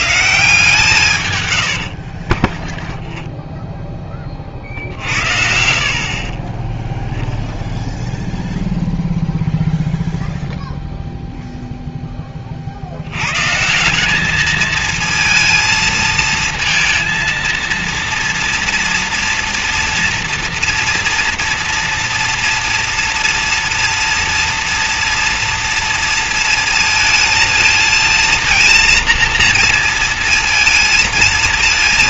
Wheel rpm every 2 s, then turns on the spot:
160, 20, 40, 20, 0, 0, 30, 220, 230, 240, 240, 230, 230, 230, 230, 230.
2-4